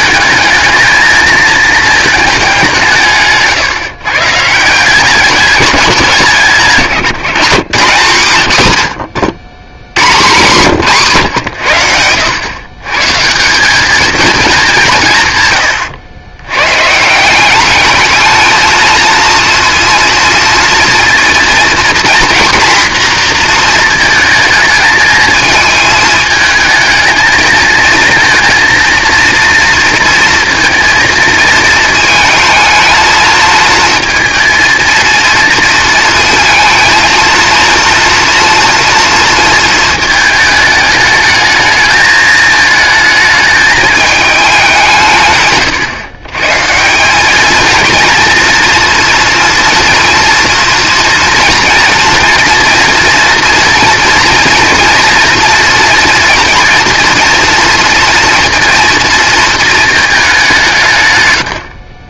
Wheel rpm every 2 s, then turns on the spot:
220, 190, 160, 170, 130, 160, 120, 210, 120, 220, 230, 240, 220, 220, 230, 230, 220, 230, 220, 230, 210, 220, 170, 160, 240, 230, 230, 240, 240, 230, 160.
none